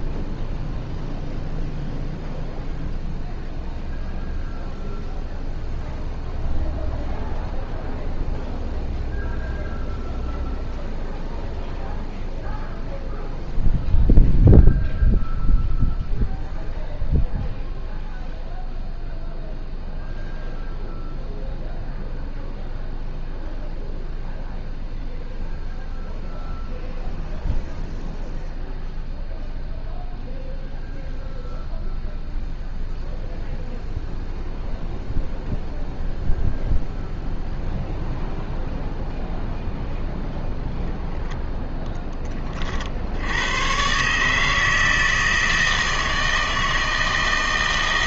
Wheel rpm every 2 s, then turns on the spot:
0, 0, 0, 0, 0, 0, 0, 0, 0, 0, 0, 0, 0, 0, 0, 0, 0, 0, 0, 0, 0, 30, 160, 160.
none